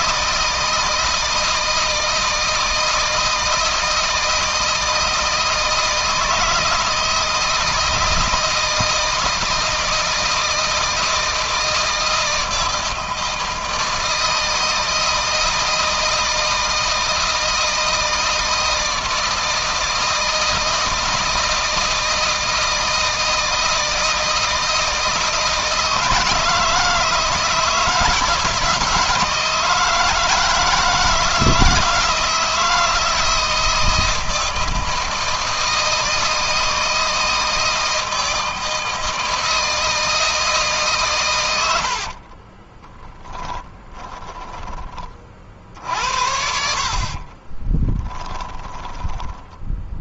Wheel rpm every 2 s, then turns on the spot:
160, 160, 160, 160, 160, 160, 160, 160, 160, 160, 160, 160, 160, 160, 160, 160, 170, 160, 160, 160, 150, 20, 30, 50, 20.
42-44 46-50